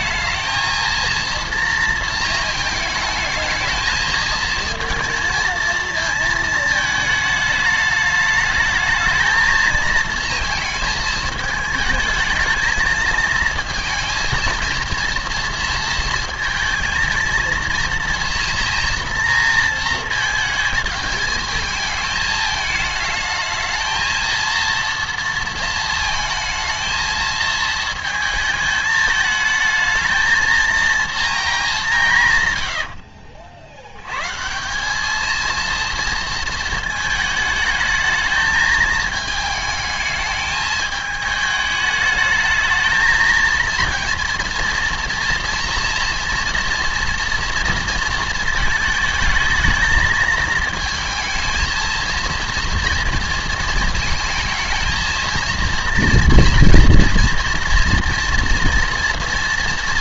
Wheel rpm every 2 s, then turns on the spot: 220, 220, 230, 220, 210, 220, 220, 230, 230, 240, 220, 220, 230, 220, 220, 230, 100, 190, 220, 220, 210, 220, 230, 230, 220, 220, 230, 220, 230, 230.
32-34